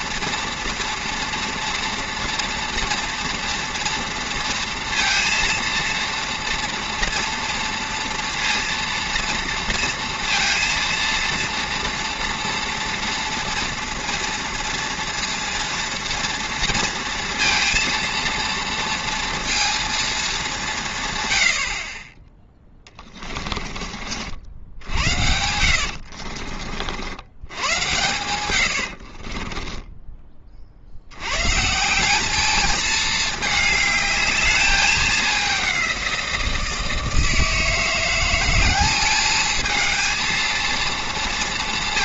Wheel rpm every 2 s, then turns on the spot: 230, 230, 230, 230, 230, 230, 230, 230, 240, 230, 190, 20, 70, 50, 90, 40, 210, 210, 170, 190, 230.
22-26